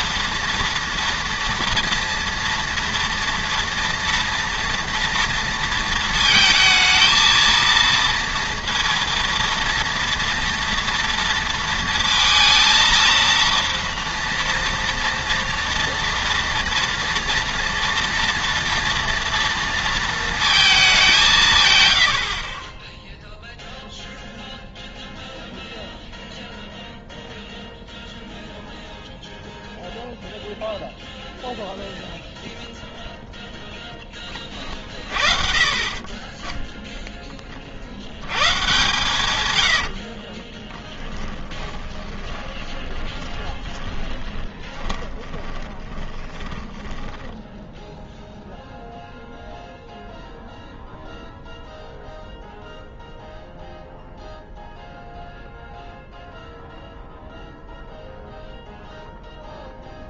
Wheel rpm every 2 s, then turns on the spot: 230, 230, 230, 220, 230, 230, 230, 230, 230, 230, 210, 10, 0, 0, 0, 0, 0, 30, 10, 120, 20, 20, 30, 20, 0, 0, 0, 0, 0, 0.
40-48